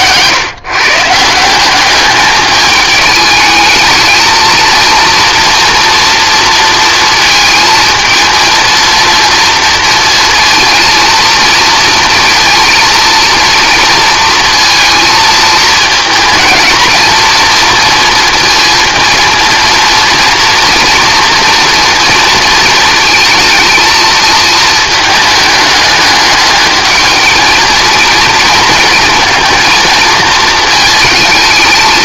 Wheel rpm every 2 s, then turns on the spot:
150, 210, 230, 230, 230, 230, 230, 230, 220, 230, 230, 230, 220, 210, 220, 220.
none